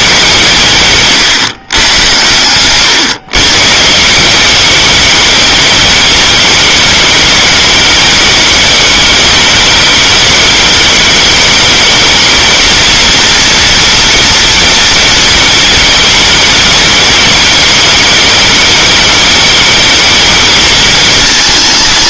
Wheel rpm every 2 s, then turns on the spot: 180, 110, 190, 220, 210, 210, 220, 230, 220, 210, 220.
2-4